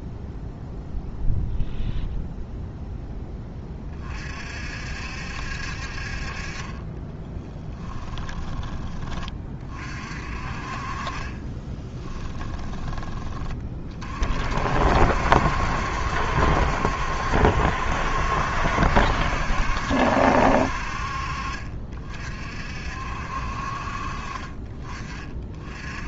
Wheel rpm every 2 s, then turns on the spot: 0, 0, 60, 20, 20, 40, 20, 60, 70, 70, 60, 50, 30.
none